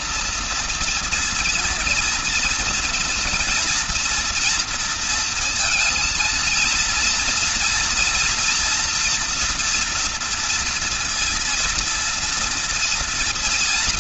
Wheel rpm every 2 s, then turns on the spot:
230, 240, 230, 230, 240, 230, 230.
none